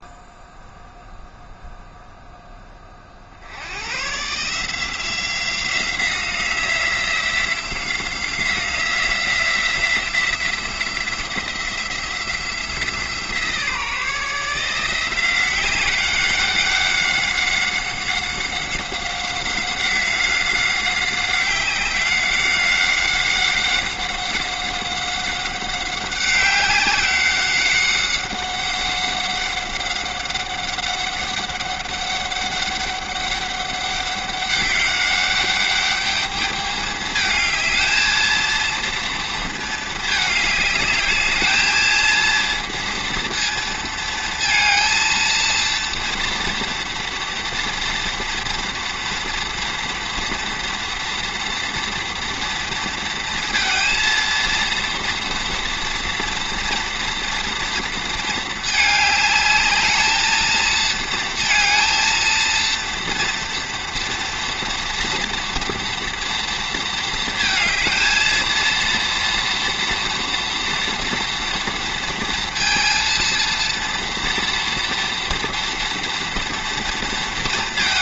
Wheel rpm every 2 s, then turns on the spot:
0, 20, 160, 180, 180, 170, 170, 170, 190, 190, 190, 190, 190, 190, 190, 190, 200, 190, 210, 230, 210, 230, 220, 230, 240, 230, 230, 230, 230, 220, 220, 230, 230, 230, 230, 230, 230, 230, 230.
none